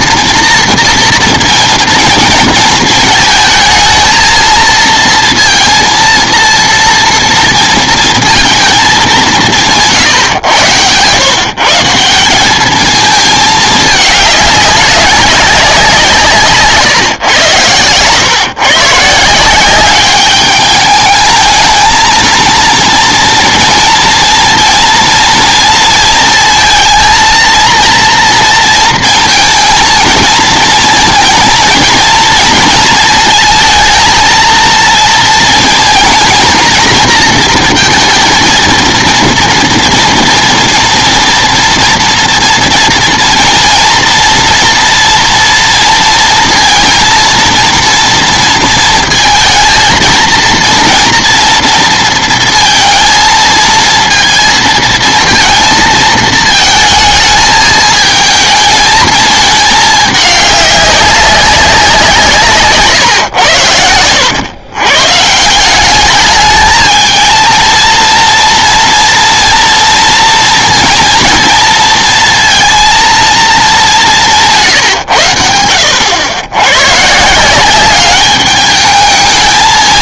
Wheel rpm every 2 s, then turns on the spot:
240, 230, 230, 230, 220, 120, 210, 200, 130, 130, 210, 230, 230, 230, 230, 220, 230, 230, 230, 230, 230, 230, 240, 230, 230, 230, 230, 230, 220, 220, 200, 130, 120, 220, 230, 230, 230, 140, 110, 210.
none